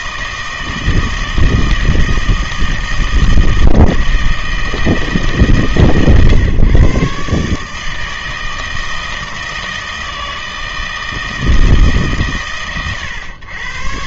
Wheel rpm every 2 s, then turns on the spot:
160, 160, 160, 130, 160, 160, 120.
none